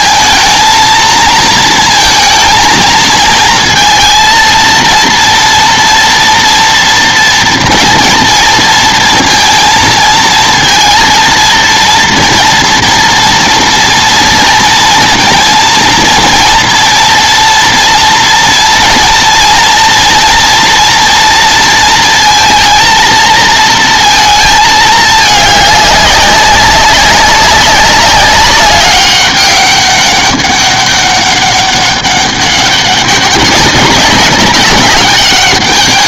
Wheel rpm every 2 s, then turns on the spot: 230, 230, 230, 230, 230, 230, 230, 230, 230, 230, 230, 230, 220, 200, 200, 200, 200, 200.
none